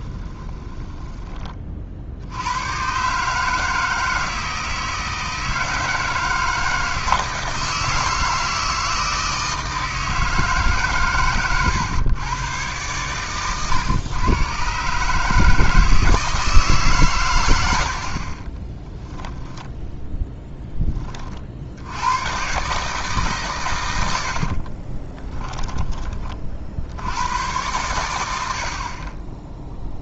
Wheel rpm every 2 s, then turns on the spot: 20, 120, 160, 160, 160, 140, 110, 130, 150, 20, 10, 140, 40, 60, 50.
0-2 18-20 24-26